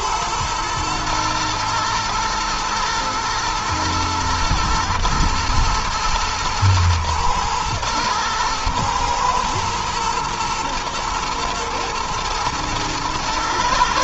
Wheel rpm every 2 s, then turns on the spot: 110, 110, 120, 110, 120, 110, 110.
none